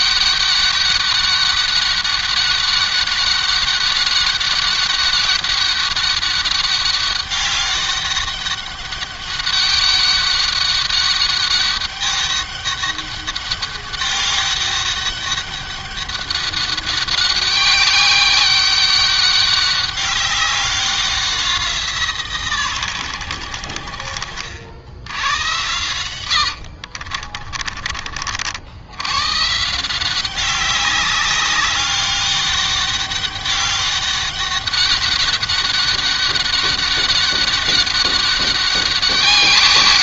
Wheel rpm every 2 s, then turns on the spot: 200, 200, 200, 200, 200, 200, 200, 200, 200, 200, 190, 120, 80, 70, 90, 200, 200, 200, 200, 200.
26-28